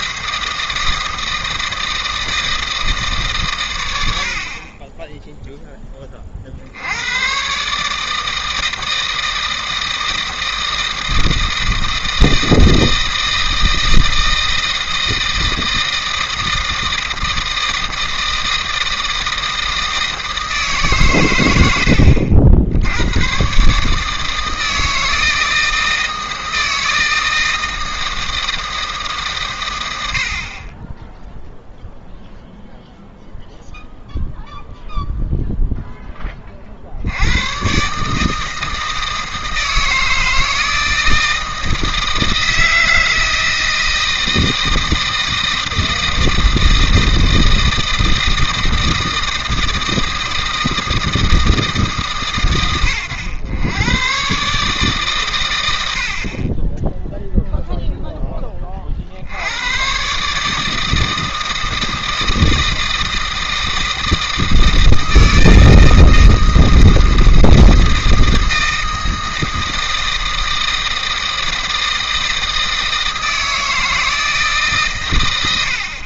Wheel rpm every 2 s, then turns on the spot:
160, 160, 40, 80, 160, 160, 160, 160, 160, 160, 150, 80, 160, 160, 160, 20, 0, 0, 40, 160, 160, 160, 160, 160, 160, 160, 110, 140, 20, 30, 160, 160, 160, 160, 160, 160, 160, 140.
none